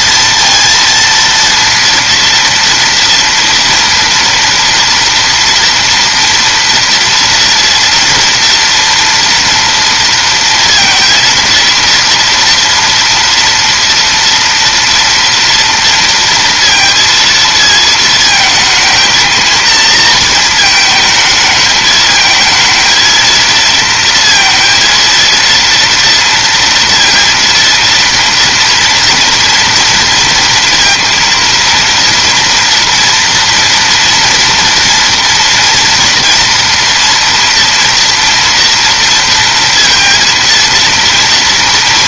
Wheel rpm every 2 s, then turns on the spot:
230, 230, 240, 240, 240, 230, 230, 230, 230, 230, 220, 230, 230, 230, 240, 230, 240, 230, 230, 230, 230.
none